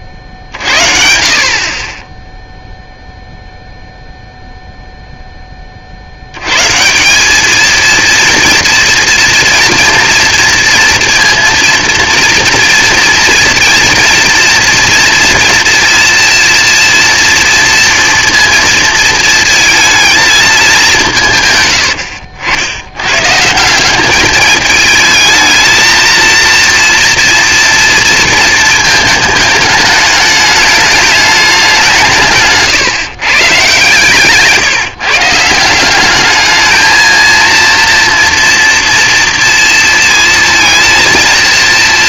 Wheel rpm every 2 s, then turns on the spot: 60, 0, 0, 140, 230, 240, 230, 230, 230, 230, 210, 80, 210, 230, 220, 210, 140, 150, 220, 230, 230.
none